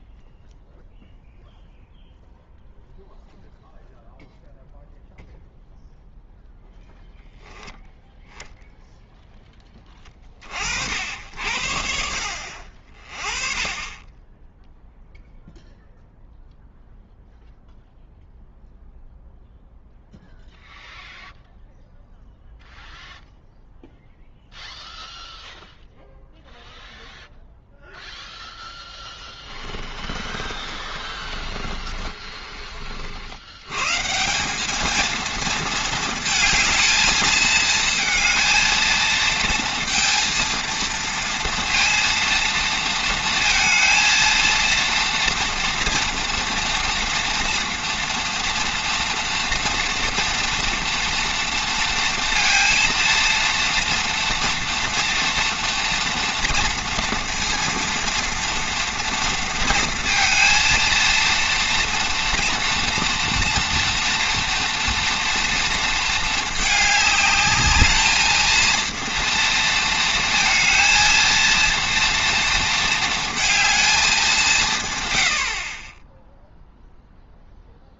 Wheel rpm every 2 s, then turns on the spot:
0, 0, 0, 0, 0, 70, 40, 0, 0, 0, 0, 0, 0, 0, 10, 30, 50, 220, 220, 220, 230, 230, 230, 230, 230, 230, 230, 230, 230, 230, 230, 240, 230, 210, 230, 230, 230, 130, 0.
28-32